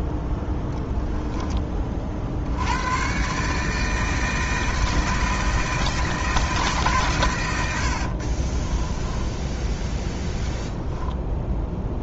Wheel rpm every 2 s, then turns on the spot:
10, 100, 160, 140, 20, 10.
0-2 8-10